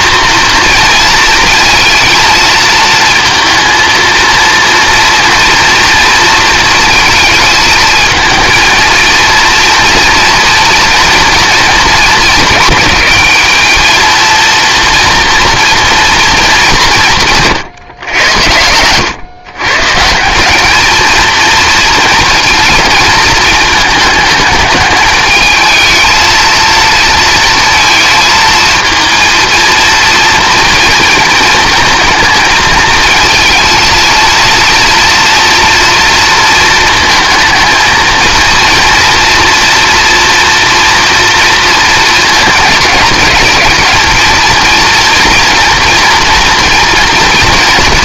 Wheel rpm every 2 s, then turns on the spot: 230, 230, 230, 230, 230, 230, 200, 230, 180, 100, 220, 220, 210, 230, 230, 230, 220, 230, 220, 230, 240, 210, 230, 230.
none